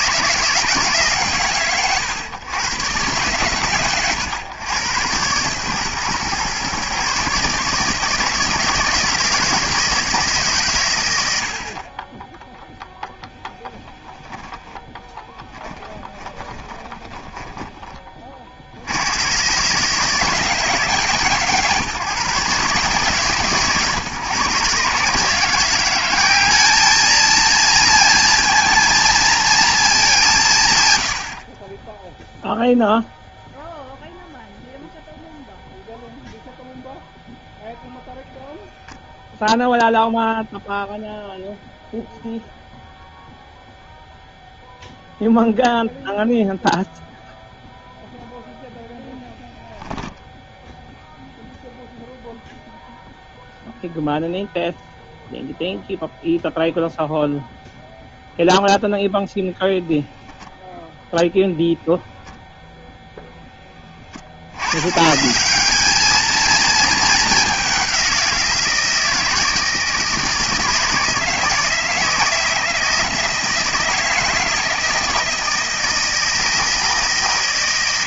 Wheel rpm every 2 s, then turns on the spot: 160, 120, 110, 130, 160, 140, 0, 10, 20, 70, 160, 150, 140, 210, 230, 130, 0, 0, 0, 0, 0, 0, 0, 0, 0, 0, 0, 0, 0, 0, 0, 0, 90, 220, 170, 160, 170, 160, 150.
14-18